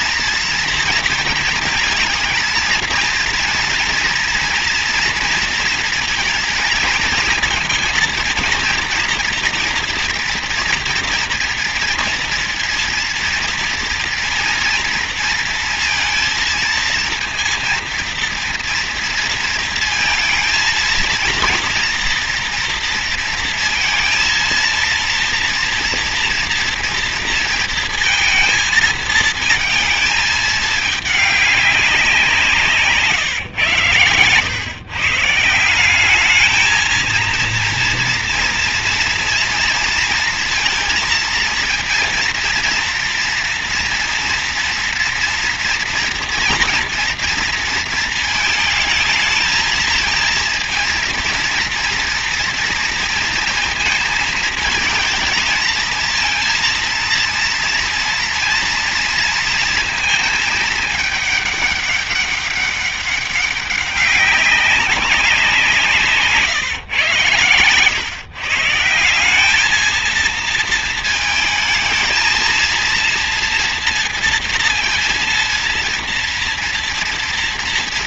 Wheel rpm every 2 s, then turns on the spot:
230, 230, 230, 230, 240, 240, 230, 230, 230, 230, 220, 230, 230, 230, 220, 210, 140, 140, 230, 230, 230, 230, 230, 230, 220, 230, 230, 230, 230, 230, 210, 200, 190, 130, 180, 220, 230, 230, 230.
none